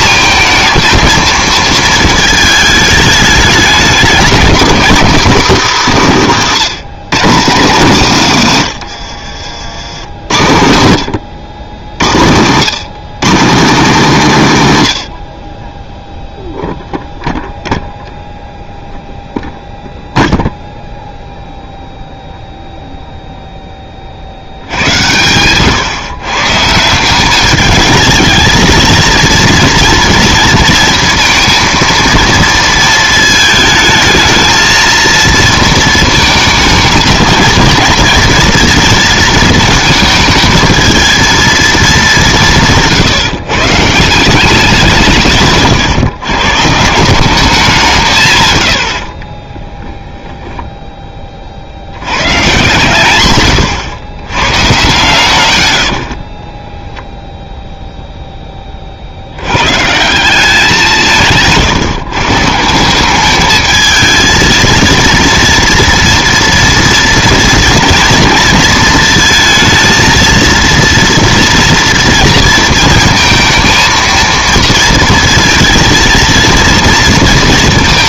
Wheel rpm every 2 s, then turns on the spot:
220, 220, 220, 190, 130, 90, 120, 170, 0, 0, 0, 0, 70, 150, 220, 230, 230, 230, 220, 220, 220, 170, 170, 140, 140, 10, 130, 100, 10, 20, 180, 160, 230, 230, 230, 230, 220, 230, 230.
56-58